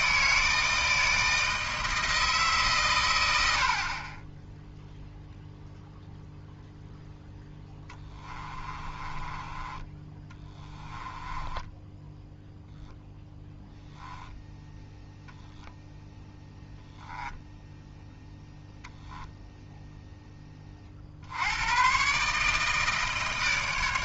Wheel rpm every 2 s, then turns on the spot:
160, 140, 0, 0, 20, 10, 0, 10, 10, 0, 30, 150.
8-12